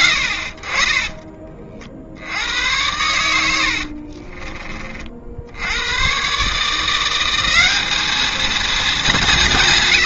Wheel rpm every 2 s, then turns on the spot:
60, 100, 30, 160, 220.
none